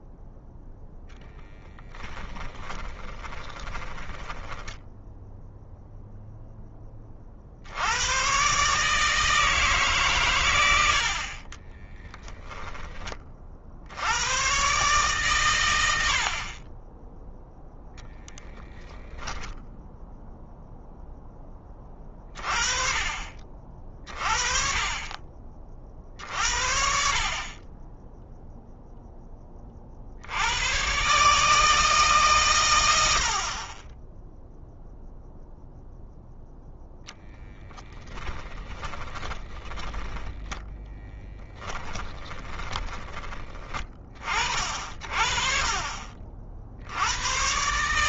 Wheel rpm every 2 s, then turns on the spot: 0, 20, 10, 10, 140, 80, 10, 130, 30, 0, 0, 30, 40, 60, 0, 110, 100, 0, 10, 30, 10, 20, 50, 80.
2-6 38-44